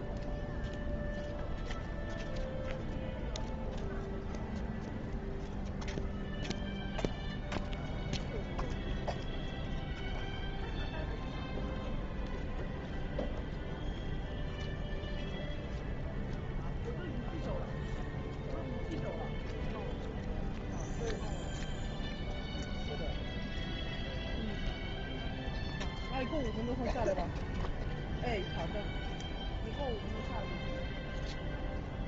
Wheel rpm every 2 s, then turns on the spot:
0, 0, 0, 0, 0, 0, 0, 0, 0, 0, 0, 0, 0, 0, 0, 0.
none